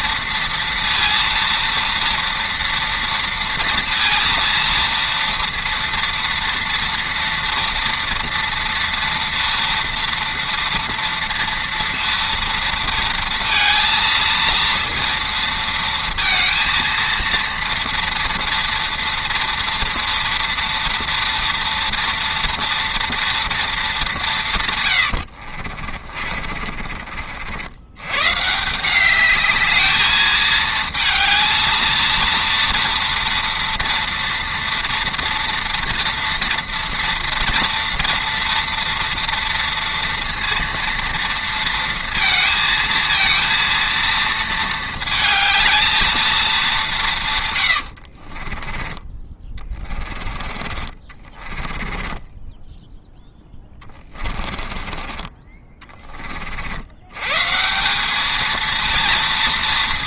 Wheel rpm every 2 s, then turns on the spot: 230, 230, 230, 230, 230, 240, 230, 230, 230, 230, 240, 230, 140, 40, 170, 220, 230, 230, 230, 230, 230, 220, 220, 200, 20, 30, 10, 20, 60, 230.
26-28 48-50 52-56